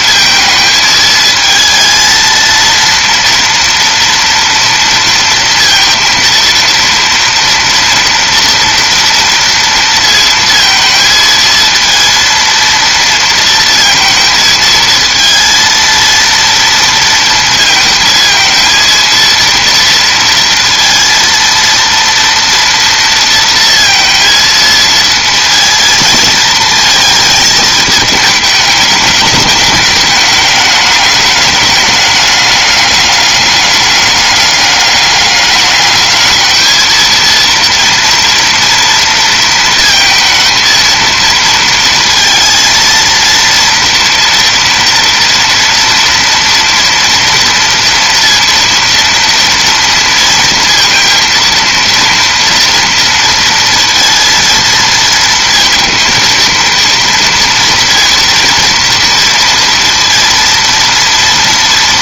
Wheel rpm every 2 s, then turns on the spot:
220, 230, 230, 230, 230, 230, 230, 220, 230, 230, 230, 230, 220, 220, 210, 210, 210, 200, 220, 230, 220, 230, 230, 230, 230, 230, 230, 230, 230, 230, 230.
none